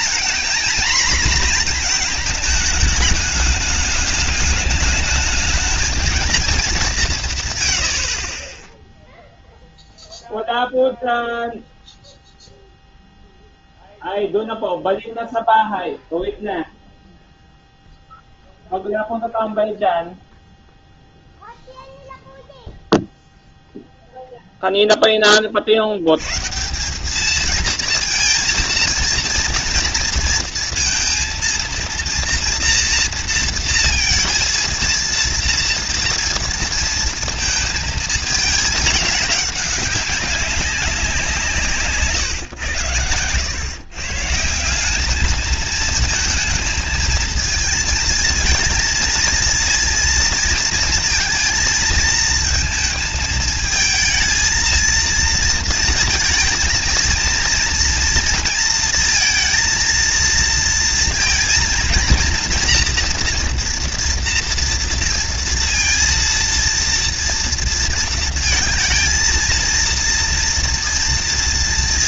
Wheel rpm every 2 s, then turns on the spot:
240, 220, 210, 200, 10, 0, 0, 0, 0, 0, 0, 0, 0, 160, 230, 230, 230, 230, 230, 210, 190, 120, 180, 230, 230, 230, 230, 230, 230, 230, 230, 230, 230, 230, 230, 230.
none